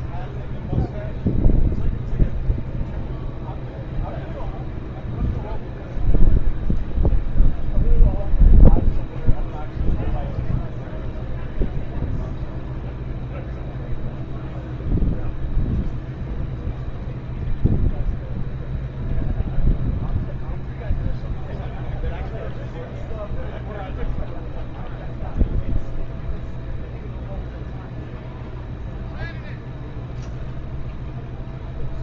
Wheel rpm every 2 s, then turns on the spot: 0, 0, 0, 0, 0, 0, 0, 0, 0, 0, 0, 0, 0, 0, 0, 0.
none